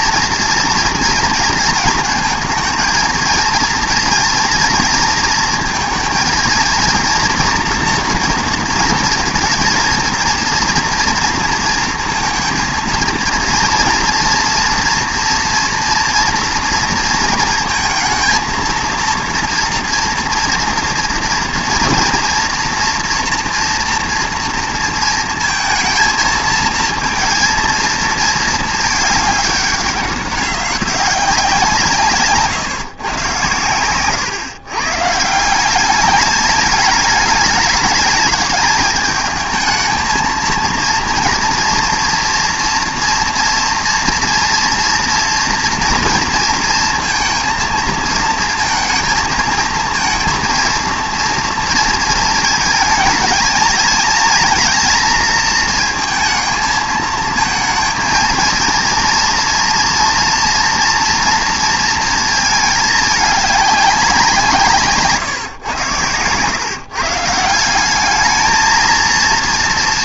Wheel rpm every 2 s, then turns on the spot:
230, 220, 230, 230, 230, 230, 230, 230, 230, 230, 230, 230, 230, 220, 220, 190, 140, 130, 210, 210, 230, 240, 230, 230, 230, 230, 220, 230, 220, 230, 230, 220, 160, 140, 220.
none